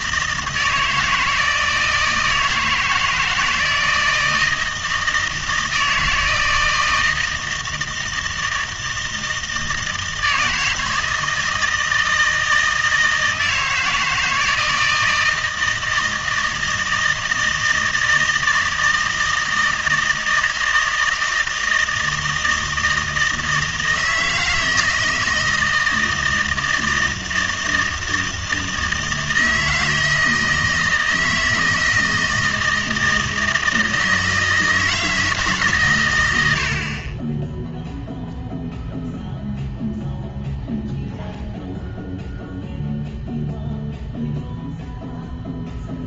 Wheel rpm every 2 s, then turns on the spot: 160, 160, 160, 160, 160, 160, 160, 160, 160, 160, 160, 160, 160, 160, 160, 160, 160, 160, 70, 0, 0, 0, 0.
none